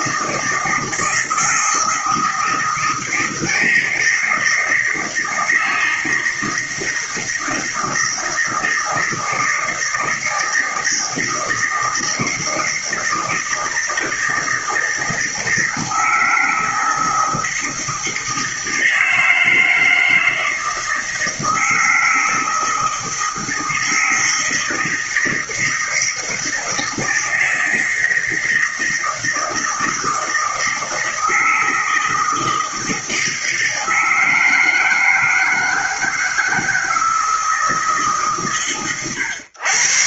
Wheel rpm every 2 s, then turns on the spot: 160, 160, 160, 160, 160, 160, 160, 160, 160, 160, 160, 160, 160, 170, 160, 160, 160, 160, 160, 110.
none